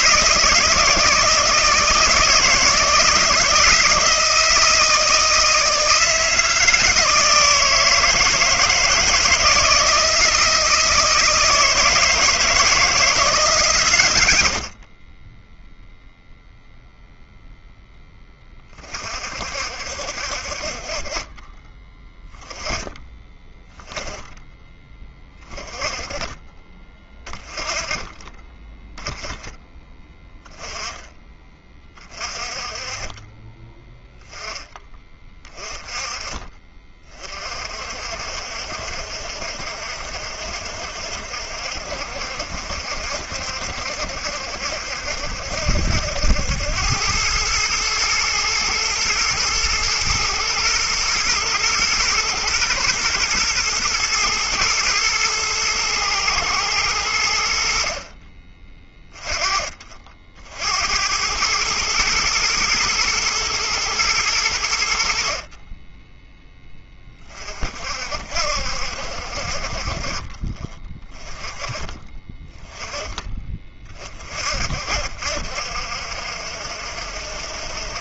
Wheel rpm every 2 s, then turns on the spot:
160, 160, 160, 160, 160, 160, 160, 70, 0, 30, 40, 10, 20, 30, 20, 10, 30, 20, 30, 60, 70, 60, 60, 90, 110, 120, 120, 120, 110, 20, 70, 110, 80, 20, 60, 20, 20, 50, 70.
none